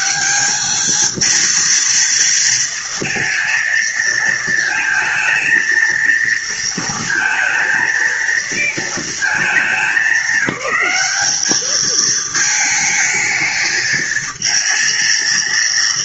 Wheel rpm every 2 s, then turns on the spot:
200, 230, 220, 220, 230, 210, 220, 230.
none